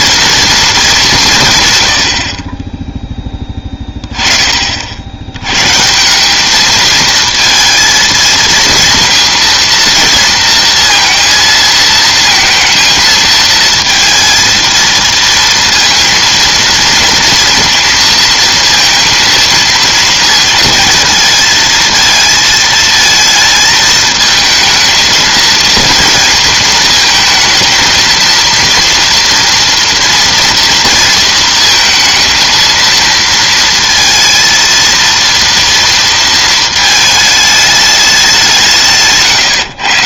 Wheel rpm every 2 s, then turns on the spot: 230, 40, 20, 190, 230, 230, 220, 230, 230, 230, 230, 220, 220, 230, 230, 240, 230, 230, 220, 190.
none